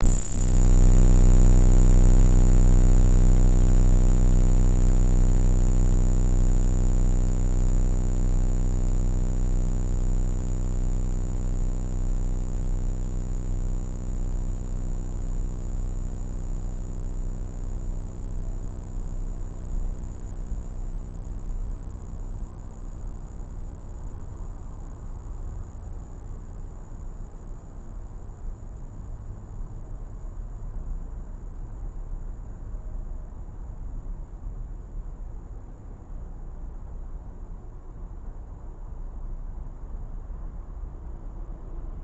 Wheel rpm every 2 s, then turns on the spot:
0, 0, 0, 0, 0, 0, 0, 0, 0, 0, 0, 0, 0, 0, 0, 0, 0, 0, 0, 0, 0.
none